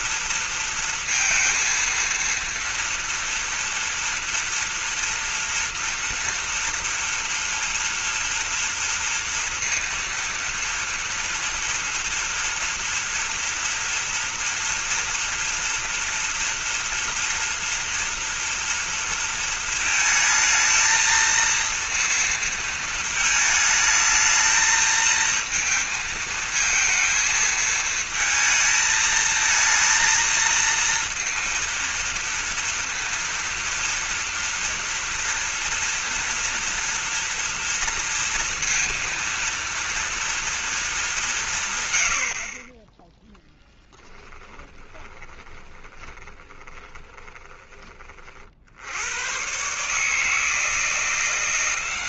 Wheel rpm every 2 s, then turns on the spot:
230, 230, 230, 230, 230, 230, 230, 230, 240, 230, 220, 230, 220, 230, 220, 230, 230, 230, 230, 230, 220, 20, 20, 10, 70, 160.
44-48